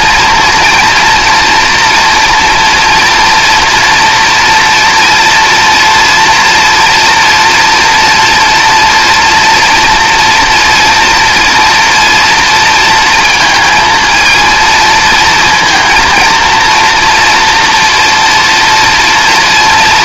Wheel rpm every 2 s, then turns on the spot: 240, 230, 230, 230, 230, 230, 230, 230, 230, 230.
none